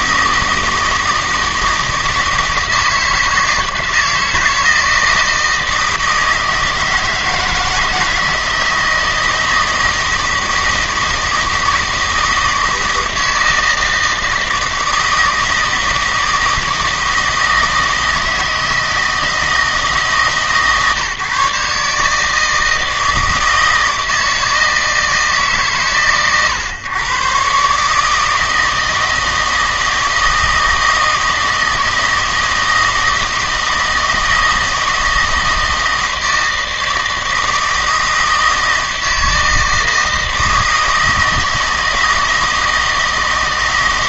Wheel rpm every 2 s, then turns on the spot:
160, 160, 160, 160, 160, 160, 160, 160, 160, 160, 140, 160, 160, 120, 160, 160, 160, 160, 160, 160, 160, 160.
none